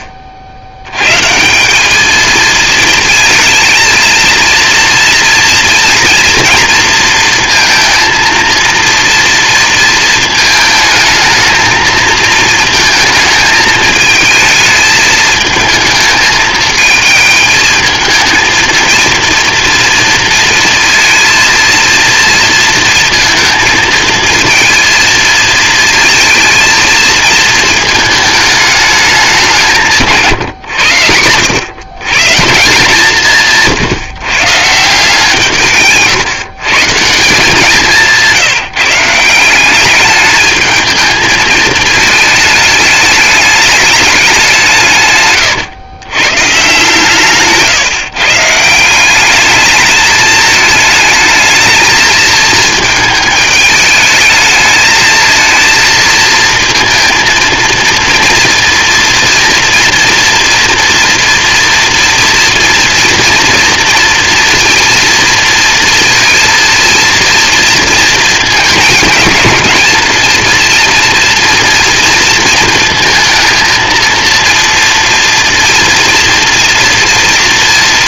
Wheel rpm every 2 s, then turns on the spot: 80, 220, 230, 230, 230, 220, 220, 220, 220, 230, 230, 220, 220, 220, 210, 100, 170, 160, 160, 180, 220, 210, 130, 160, 190, 220, 220, 220, 230, 230, 230, 230, 230, 230, 220, 230, 230, 230, 230.
none